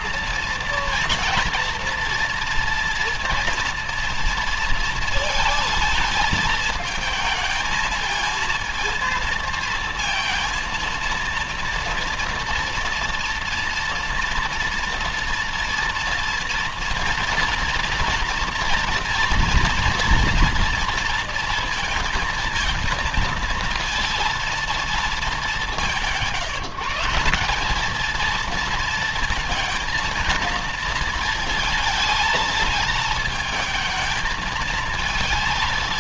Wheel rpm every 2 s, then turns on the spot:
230, 230, 230, 220, 230, 230, 230, 230, 230, 230, 230, 220, 230, 160, 230, 220, 220, 220.
none